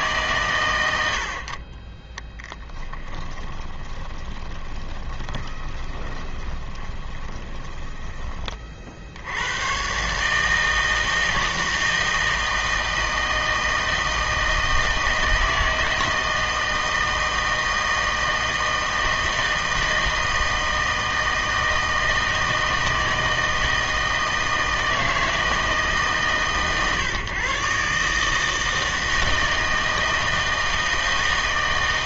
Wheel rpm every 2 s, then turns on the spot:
110, 10, 20, 20, 30, 160, 160, 160, 160, 160, 160, 160, 160, 130, 160, 160.
2-8